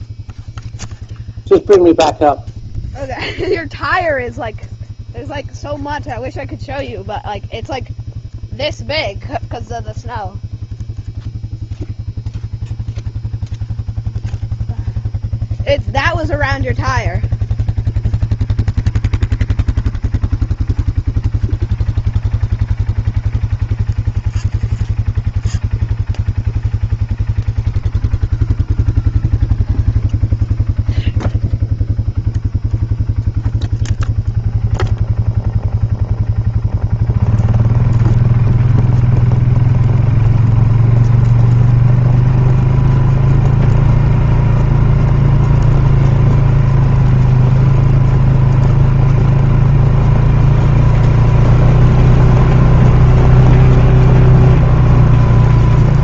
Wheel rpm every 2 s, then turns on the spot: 0, 0, 0, 0, 0, 0, 0, 0, 0, 0, 0, 0, 0, 0, 0, 0, 0, 0, 0, 0, 0, 0, 0, 0, 0, 0, 0, 0.
none